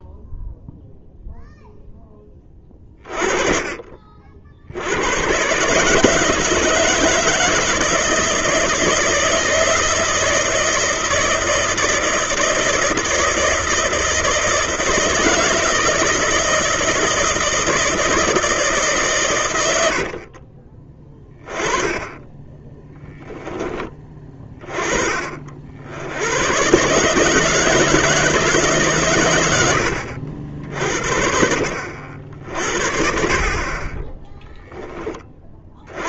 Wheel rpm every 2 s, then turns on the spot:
0, 20, 60, 160, 160, 160, 160, 160, 160, 160, 40, 10, 20, 110, 150, 60, 50, 10.
20-24